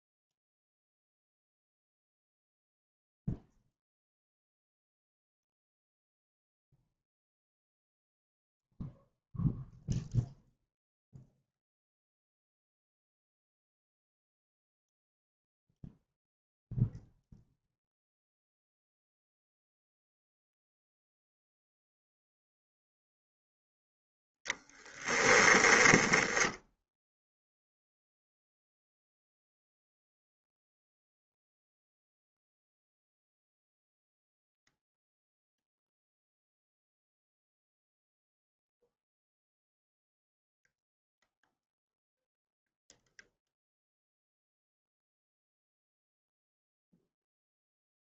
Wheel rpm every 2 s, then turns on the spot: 0, 0, 0, 0, 0, 0, 0, 0, 0, 0, 0, 0, 10, 0, 0, 0, 0, 0, 0, 0, 0, 0, 0, 0.
24-26